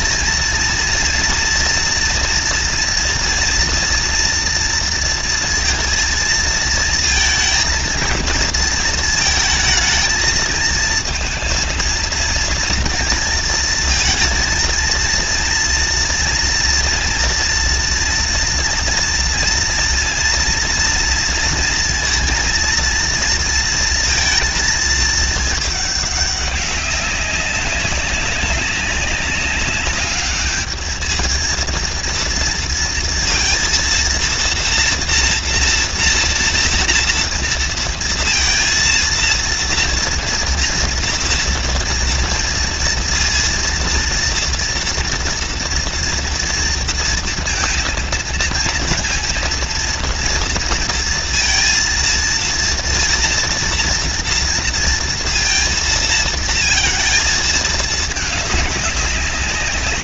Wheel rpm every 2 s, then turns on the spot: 230, 240, 230, 230, 230, 220, 230, 230, 230, 230, 230, 230, 220, 200, 200, 210, 230, 230, 230, 230, 230, 230, 230, 230, 230, 230, 230, 230, 230, 210.
none